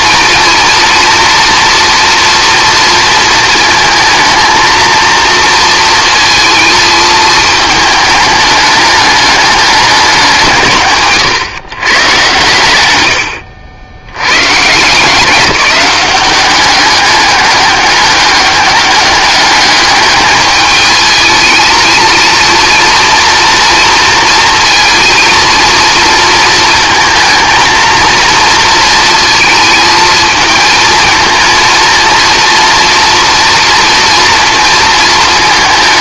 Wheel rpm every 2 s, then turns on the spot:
230, 230, 230, 220, 210, 150, 90, 160, 200, 200, 220, 230, 230, 220, 230, 220, 230, 230.
none